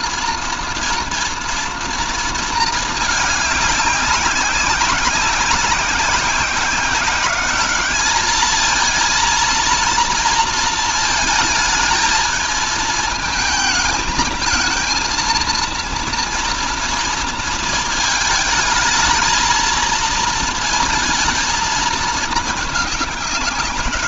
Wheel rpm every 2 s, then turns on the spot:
230, 220, 190, 190, 220, 230, 220, 220, 230, 220, 230, 210.
none